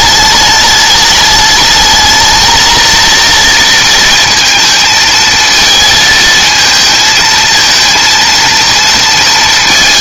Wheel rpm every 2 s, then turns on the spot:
210, 220, 220, 220, 230.
none